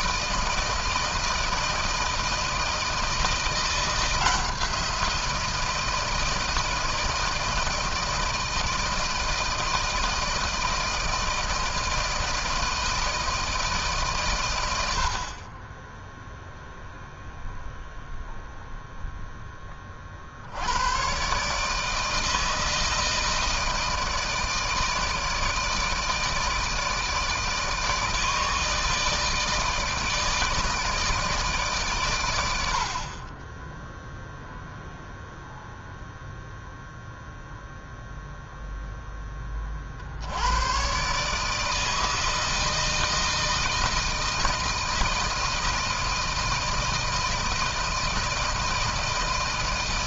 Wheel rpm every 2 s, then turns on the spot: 160, 160, 170, 160, 160, 160, 160, 120, 0, 0, 80, 160, 160, 160, 160, 160, 80, 0, 0, 0, 90, 160, 160, 160, 160.
none